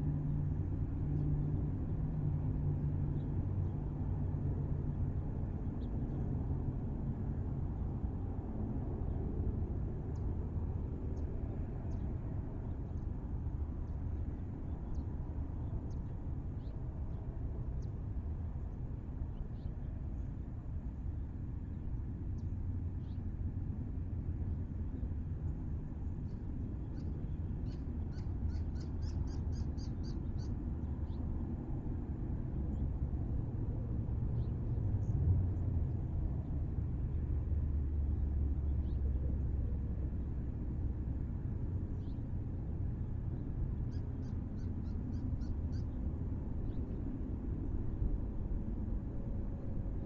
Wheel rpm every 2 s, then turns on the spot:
0, 0, 0, 0, 0, 0, 0, 0, 0, 0, 0, 0, 0, 0, 0, 0, 0, 0, 0, 0, 0, 0, 0, 0, 0.
none